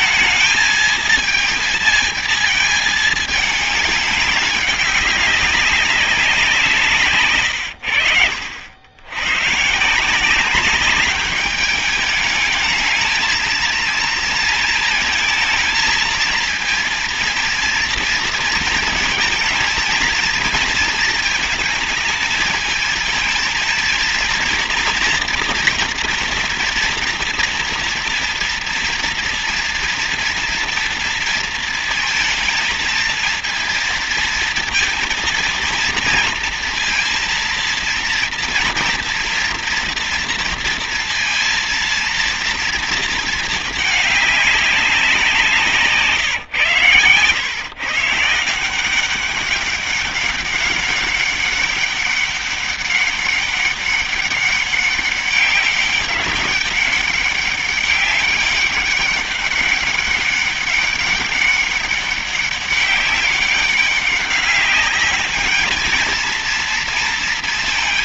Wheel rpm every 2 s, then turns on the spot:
220, 220, 200, 160, 70, 200, 210, 230, 230, 230, 230, 220, 230, 230, 230, 230, 220, 230, 230, 230, 230, 230, 200, 130, 160, 200, 200, 200, 200, 200, 200, 200, 200, 230.
none